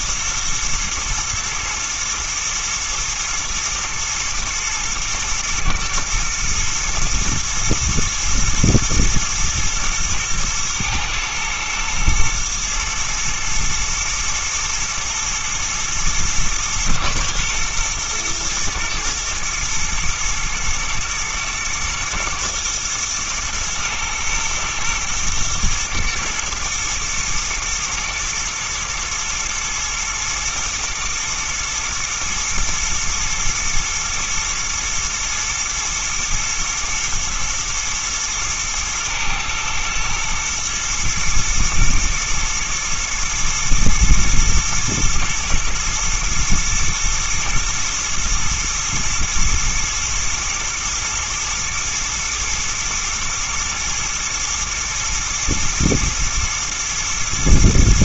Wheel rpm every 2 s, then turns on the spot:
120, 110, 120, 120, 110, 110, 110, 120, 110, 120, 120, 120, 110, 110, 110, 120, 120, 120, 110, 110, 110, 110, 110, 110, 110, 120, 120, 110, 120.
none